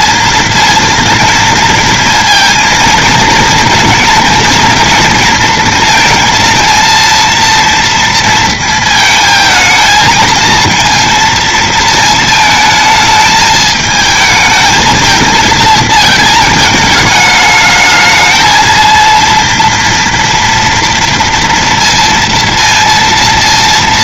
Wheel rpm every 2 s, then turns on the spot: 230, 230, 230, 230, 230, 230, 220, 220, 220, 230, 230, 230.
none